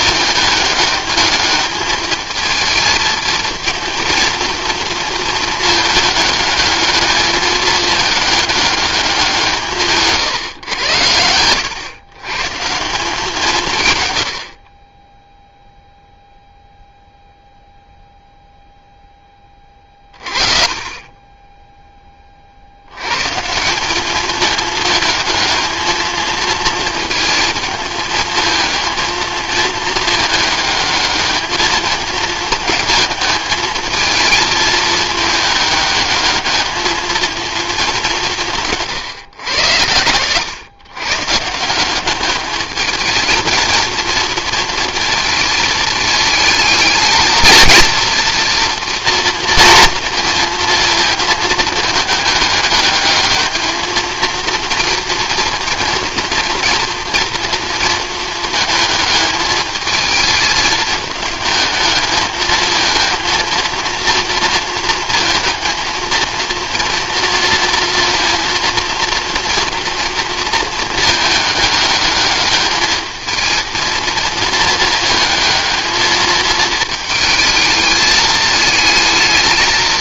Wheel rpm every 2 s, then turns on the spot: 210, 220, 230, 210, 210, 110, 150, 50, 0, 0, 40, 60, 220, 220, 220, 210, 220, 220, 210, 160, 120, 210, 230, 220, 230, 230, 210, 230, 240, 220, 220, 220, 230, 230, 230, 230, 220, 220, 220, 220.
none